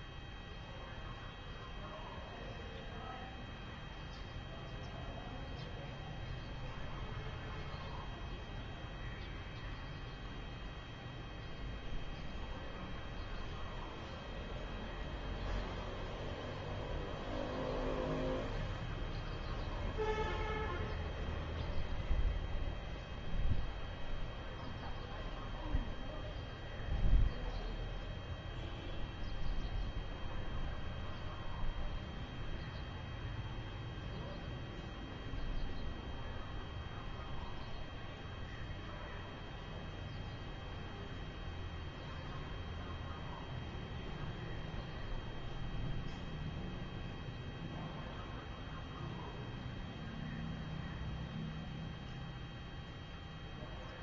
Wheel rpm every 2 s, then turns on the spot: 0, 0, 0, 0, 0, 0, 0, 0, 0, 0, 0, 0, 0, 0, 0, 0, 0, 0, 0, 0, 0, 0, 0, 0, 0, 0, 0.
none